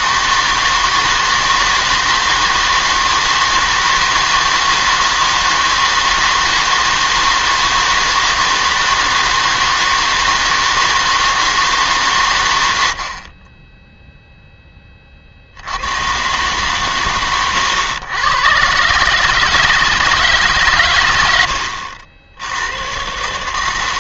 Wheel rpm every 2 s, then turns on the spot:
160, 160, 160, 160, 160, 160, 100, 10, 120, 130, 140, 90.
none